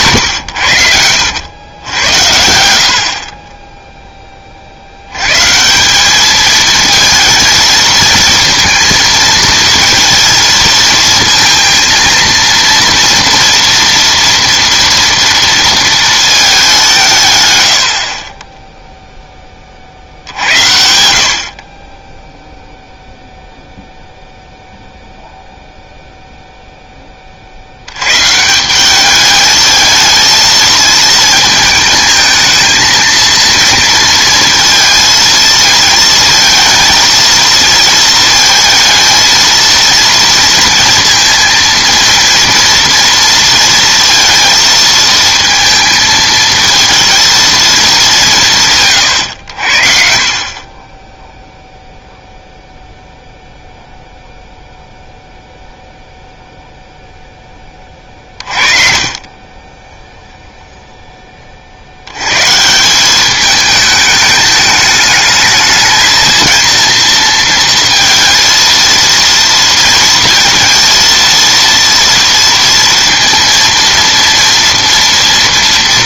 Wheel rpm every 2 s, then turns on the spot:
100, 80, 50, 220, 230, 220, 230, 230, 210, 20, 70, 0, 0, 0, 160, 220, 220, 230, 220, 230, 230, 230, 230, 220, 160, 30, 0, 0, 0, 30, 0, 130, 210, 230, 220, 230, 230, 230.
none